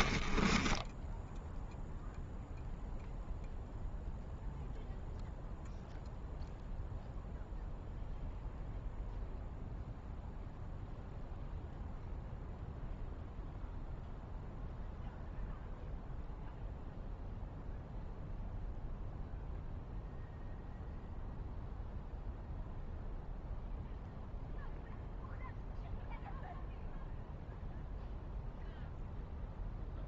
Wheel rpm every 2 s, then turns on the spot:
10, 0, 0, 0, 0, 0, 0, 0, 0, 0, 0, 0, 0, 0, 0.
0-2